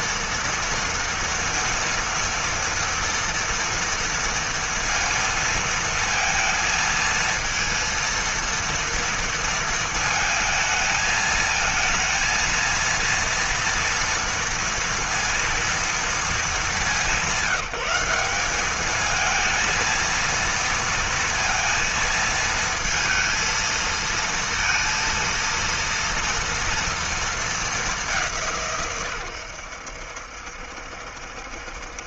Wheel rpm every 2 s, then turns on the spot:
230, 230, 230, 230, 230, 220, 230, 230, 190, 210, 230, 230, 230, 230, 130, 70.
none